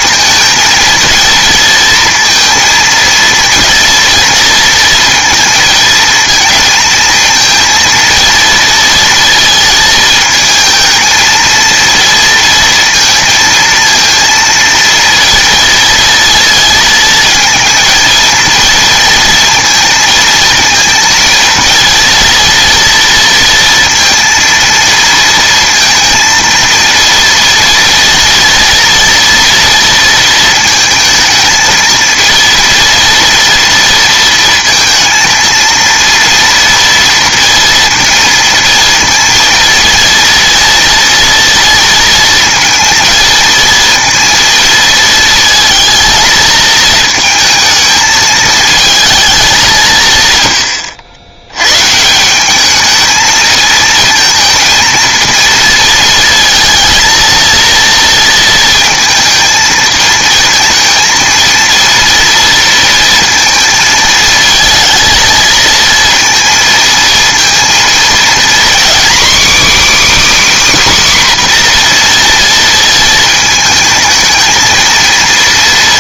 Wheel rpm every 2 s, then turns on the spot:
220, 230, 230, 230, 230, 220, 230, 230, 230, 230, 230, 230, 230, 230, 230, 220, 230, 230, 230, 230, 230, 230, 230, 220, 220, 120, 200, 230, 230, 230, 230, 230, 220, 230, 250, 300, 230, 220.
none